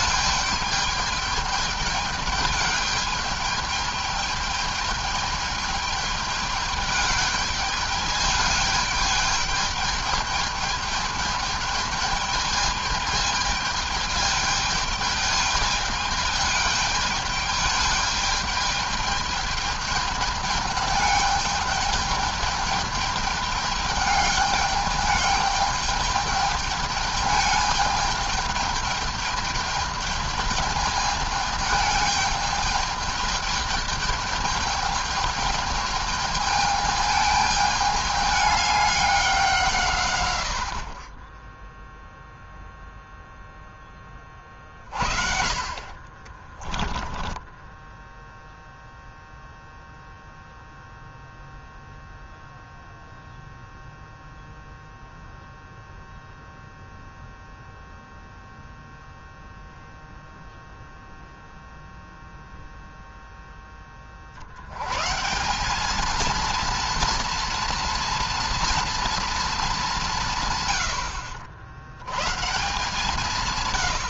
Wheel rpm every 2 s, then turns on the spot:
210, 210, 210, 210, 210, 210, 210, 210, 210, 210, 210, 210, 210, 210, 220, 210, 210, 210, 220, 200, 40, 0, 50, 10, 0, 0, 0, 0, 0, 0, 0, 0, 130, 230, 230, 90, 160.
46-48